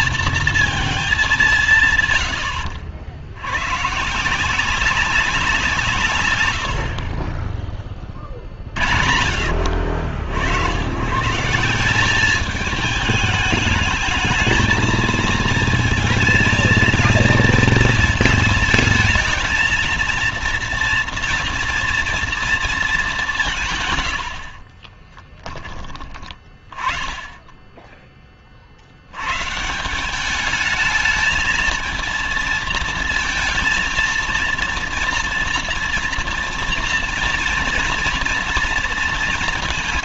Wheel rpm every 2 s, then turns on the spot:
230, 100, 170, 100, 40, 80, 200, 220, 230, 220, 230, 230, 80, 20, 40, 200, 230, 230, 230, 240.
24-26